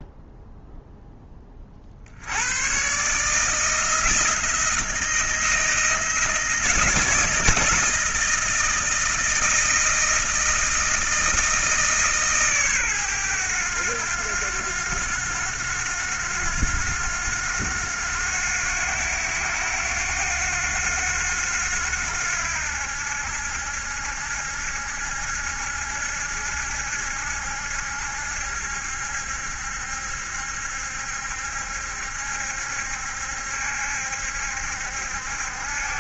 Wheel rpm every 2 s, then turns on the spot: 0, 80, 160, 170, 160, 160, 150, 90, 90, 90, 90, 90, 70, 70, 70, 70, 70, 70.
none